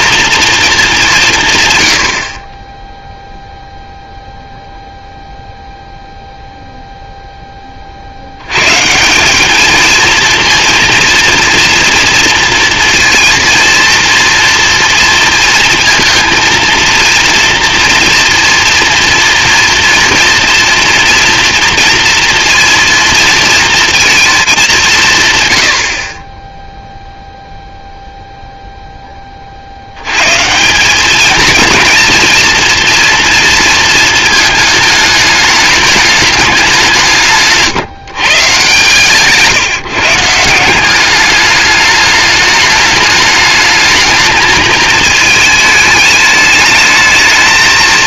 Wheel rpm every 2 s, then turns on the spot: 220, 10, 0, 0, 140, 240, 230, 230, 230, 230, 230, 230, 190, 0, 10, 190, 230, 220, 180, 140, 180, 210, 220, 220.
none